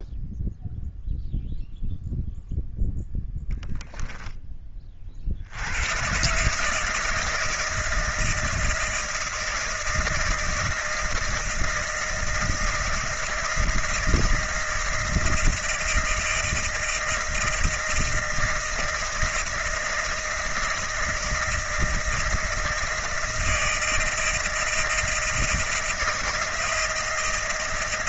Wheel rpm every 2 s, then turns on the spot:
0, 0, 40, 160, 160, 160, 160, 160, 160, 160, 160, 160, 160, 160.
none